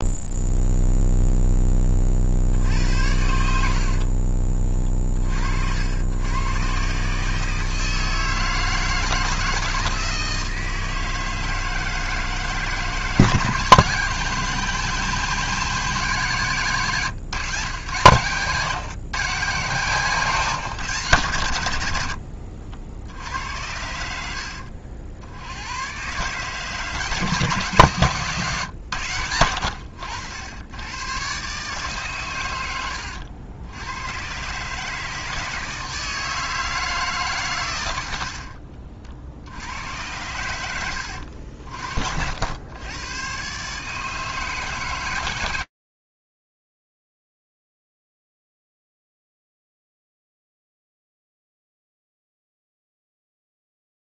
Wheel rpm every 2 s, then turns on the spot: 0, 60, 40, 120, 160, 160, 160, 160, 140, 120, 140, 70, 80, 160, 140, 80, 110, 140, 160, 60, 100, 90, 140, 120, 40, 0, 0.
38-40